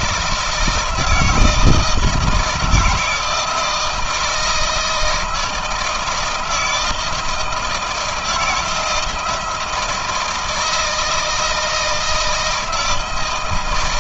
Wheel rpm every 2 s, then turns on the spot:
160, 160, 160, 160, 170, 160, 160.
none